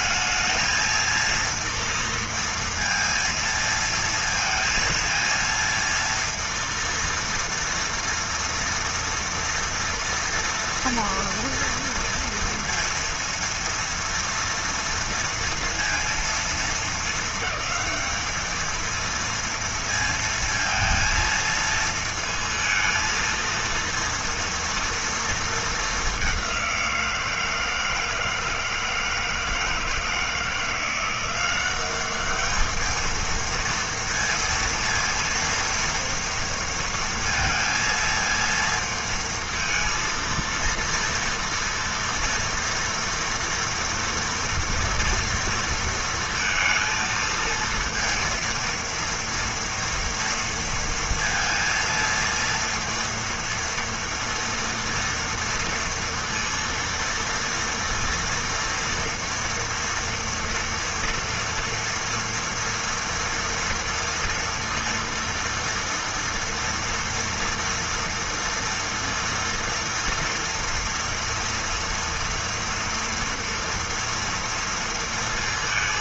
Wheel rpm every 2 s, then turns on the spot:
220, 230, 230, 230, 230, 230, 230, 230, 220, 220, 230, 230, 230, 190, 160, 170, 210, 230, 230, 230, 230, 230, 230, 230, 230, 230, 230, 230, 230, 240, 230, 230, 230, 230, 230, 240, 230, 230.
none